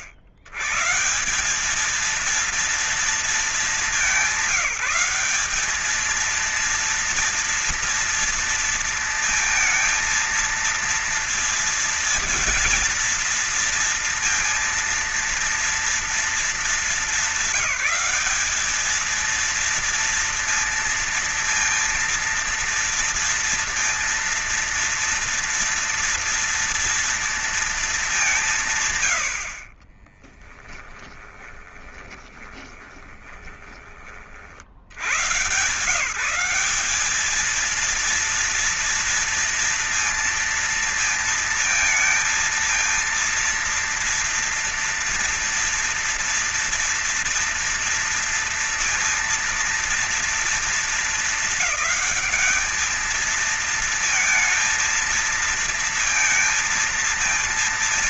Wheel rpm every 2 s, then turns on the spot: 110, 230, 190, 220, 230, 230, 230, 230, 230, 210, 230, 230, 230, 230, 150, 10, 20, 70, 190, 230, 230, 230, 230, 230, 230, 220, 220, 230, 230.
30-34